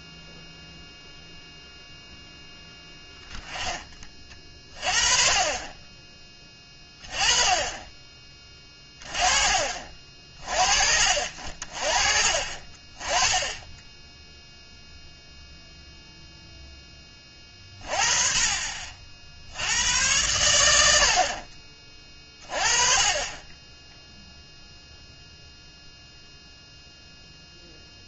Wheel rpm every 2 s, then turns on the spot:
0, 10, 30, 20, 20, 50, 40, 0, 10, 40, 90, 30, 0, 0.
none